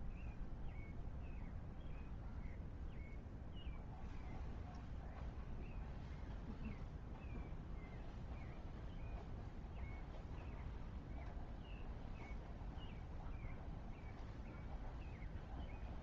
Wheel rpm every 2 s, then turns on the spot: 0, 0, 0, 0, 0, 0, 0, 0.
none